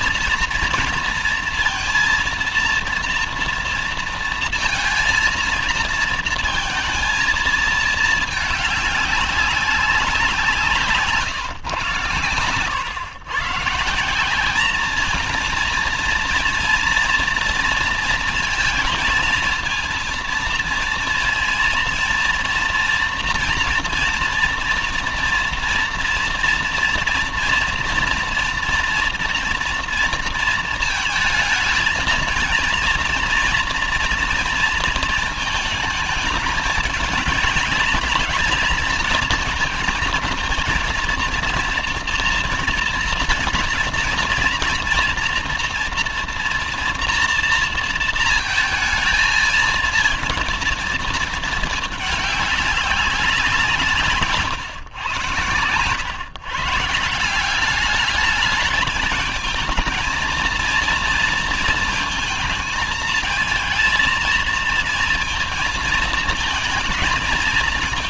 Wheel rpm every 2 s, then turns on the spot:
230, 230, 230, 230, 210, 170, 110, 200, 240, 230, 230, 230, 230, 230, 240, 230, 220, 230, 210, 220, 220, 230, 230, 230, 220, 230, 200, 120, 140, 210, 220, 220, 230, 230.
none